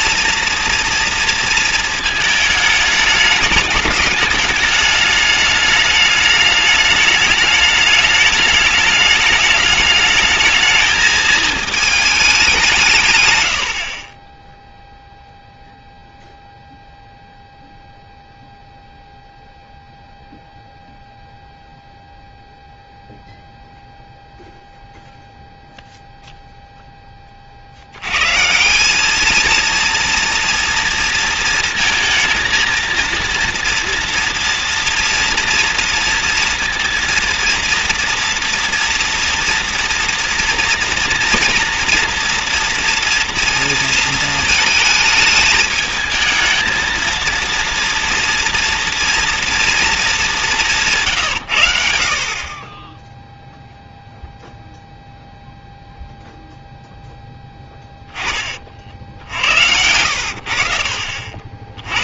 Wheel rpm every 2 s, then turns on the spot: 230, 220, 210, 210, 210, 220, 190, 10, 0, 0, 0, 0, 0, 40, 220, 230, 230, 240, 230, 230, 230, 230, 220, 230, 230, 110, 0, 0, 0, 50, 50.
14-16